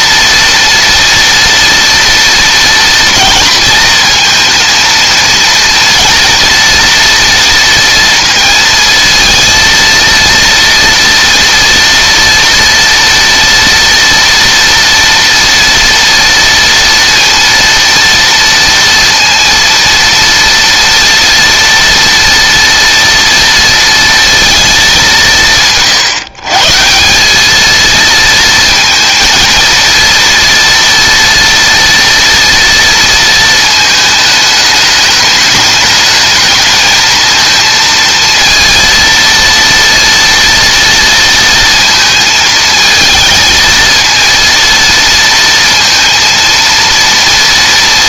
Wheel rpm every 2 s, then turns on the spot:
230, 240, 230, 240, 230, 230, 230, 230, 230, 230, 230, 230, 220, 160, 230, 230, 230, 210, 220, 230, 230, 220, 230, 230.
none